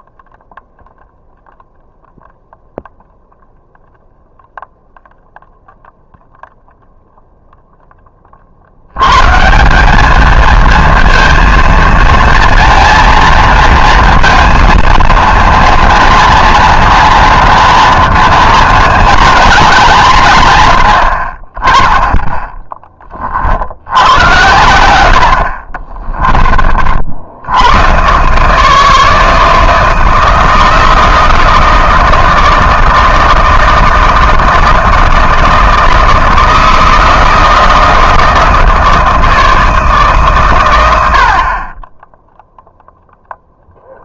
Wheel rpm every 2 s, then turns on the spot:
0, 0, 0, 0, 70, 220, 230, 230, 230, 230, 110, 10, 100, 40, 150, 160, 160, 160, 160, 160, 120, 0.
none